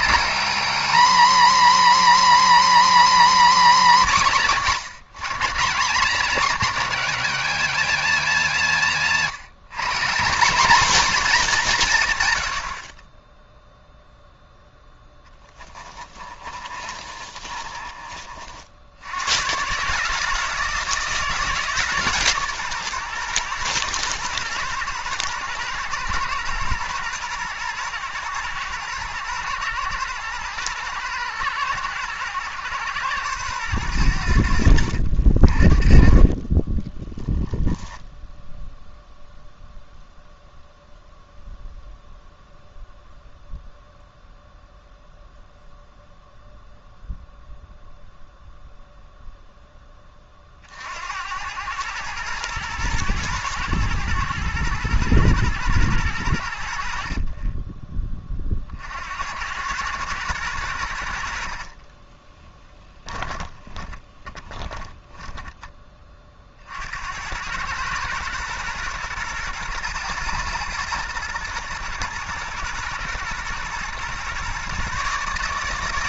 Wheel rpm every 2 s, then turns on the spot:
290, 310, 180, 230, 160, 230, 30, 10, 30, 80, 160, 120, 120, 120, 120, 110, 120, 70, 20, 0, 0, 0, 0, 0, 0, 60, 110, 110, 70, 50, 90, 20, 30, 50, 120, 120, 120, 130.
14-18 36-38 62-66